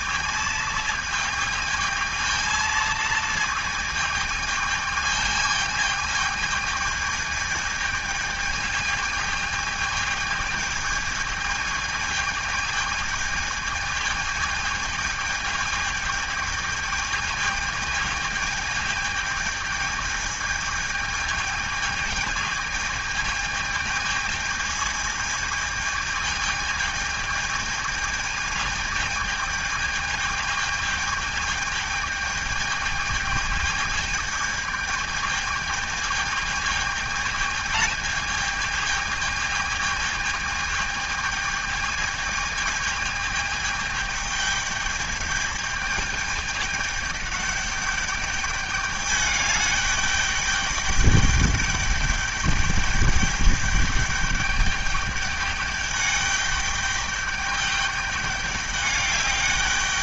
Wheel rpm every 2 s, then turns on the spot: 220, 220, 220, 220, 220, 220, 220, 220, 220, 220, 220, 210, 220, 220, 220, 210, 220, 220, 220, 220, 210, 220, 220, 210, 210, 210, 210, 210, 210, 210.
none